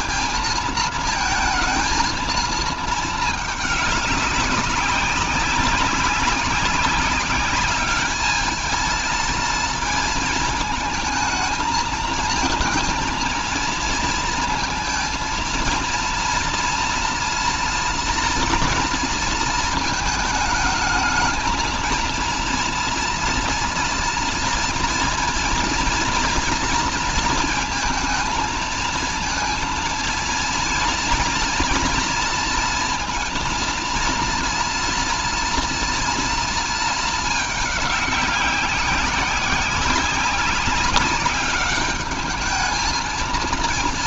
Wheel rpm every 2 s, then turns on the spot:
230, 220, 200, 200, 220, 220, 220, 230, 230, 230, 220, 230, 230, 230, 230, 230, 230, 230, 220, 190, 200, 220.
none